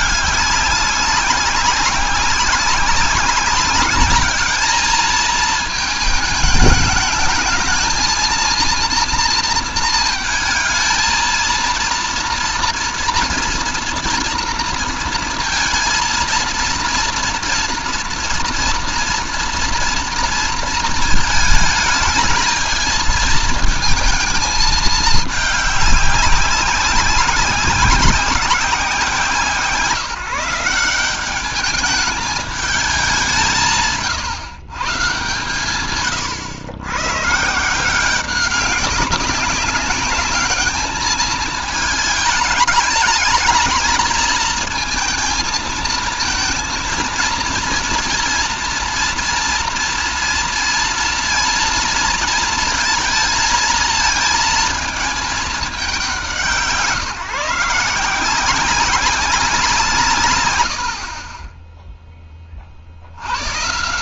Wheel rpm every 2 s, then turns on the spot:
200, 190, 210, 210, 230, 220, 230, 230, 230, 230, 230, 220, 220, 190, 180, 170, 210, 140, 110, 200, 210, 220, 220, 230, 240, 230, 230, 220, 150, 180, 100, 60.
none